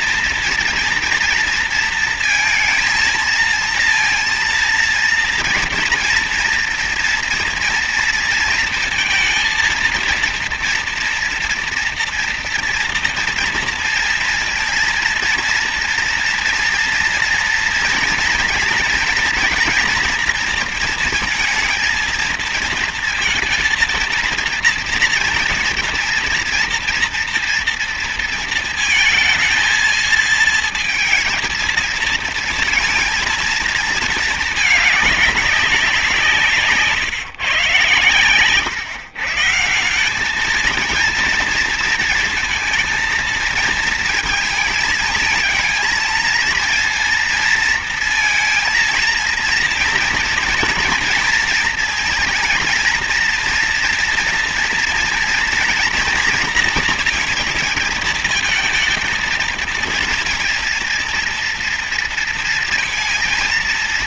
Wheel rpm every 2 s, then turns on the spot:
240, 230, 230, 230, 230, 230, 230, 230, 230, 240, 230, 230, 230, 230, 230, 220, 230, 220, 170, 130, 200, 230, 220, 230, 230, 230, 230, 230, 230, 230, 230, 230.
none